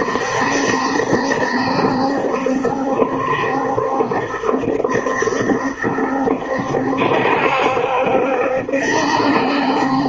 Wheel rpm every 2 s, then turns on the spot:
70, 70, 70, 70, 70.
none